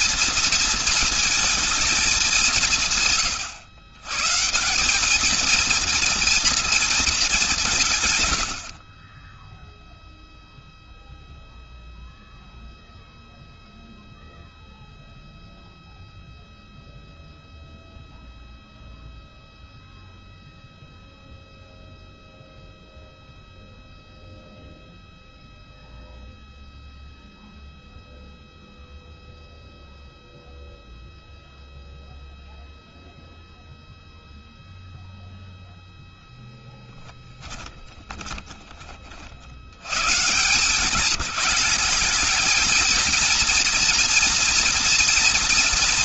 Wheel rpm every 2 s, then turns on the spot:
230, 180, 160, 230, 80, 0, 0, 0, 0, 0, 0, 0, 0, 0, 0, 0, 0, 0, 10, 20, 160, 220, 230.
36-38